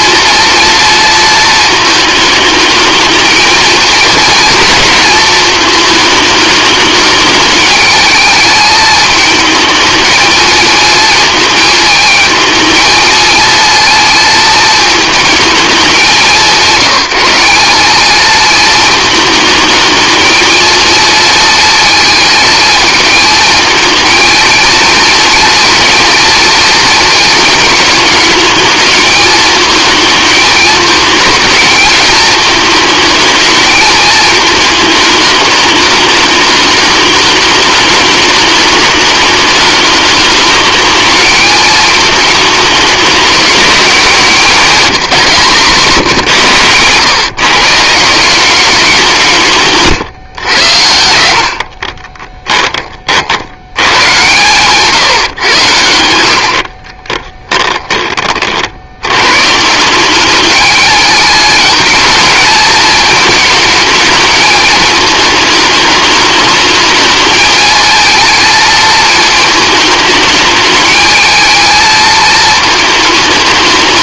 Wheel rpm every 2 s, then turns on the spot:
230, 220, 220, 210, 220, 220, 220, 220, 190, 220, 230, 220, 230, 230, 210, 220, 220, 220, 210, 210, 220, 220, 200, 140, 190, 90, 30, 140, 30, 80, 210, 220, 220, 220, 220, 210, 220.
50-52 56-58